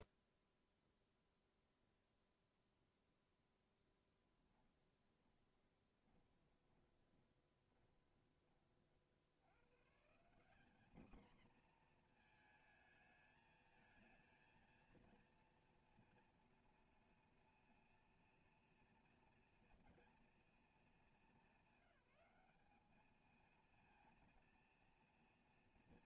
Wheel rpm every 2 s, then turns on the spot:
0, 0, 20, 20, 20, 200, 230, 230, 230, 230, 230, 200, 230.
4-8